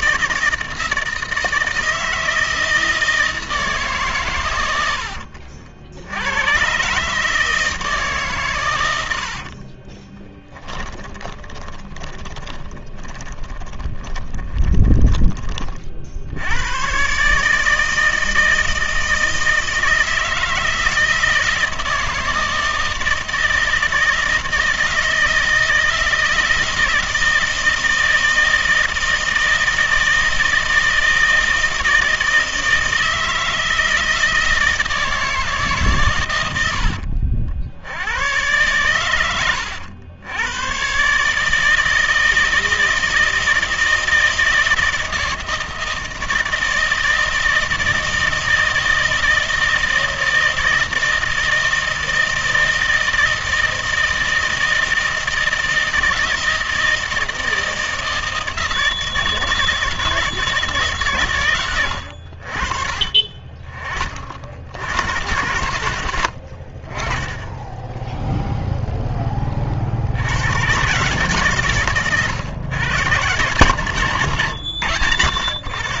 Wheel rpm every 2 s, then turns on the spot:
160, 160, 120, 120, 120, 10, 20, 20, 90, 160, 160, 160, 160, 160, 160, 160, 160, 160, 90, 110, 110, 160, 160, 160, 160, 160, 160, 160, 160, 160, 160, 50, 70, 50, 0, 120, 120, 110.
10-16